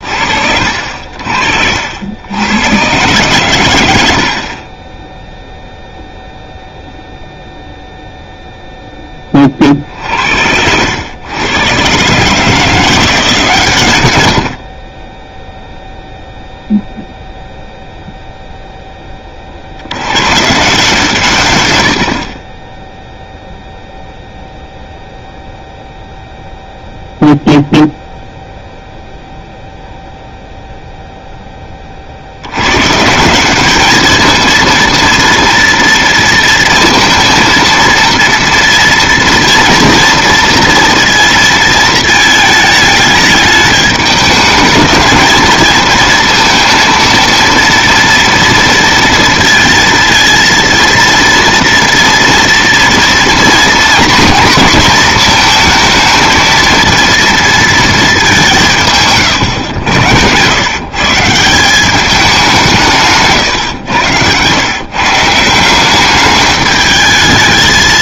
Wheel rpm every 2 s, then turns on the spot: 60, 120, 20, 0, 10, 100, 170, 30, 0, 10, 150, 0, 0, 0, 0, 0, 130, 230, 230, 230, 230, 220, 220, 230, 230, 230, 240, 230, 230, 150, 140, 160, 140, 210.
none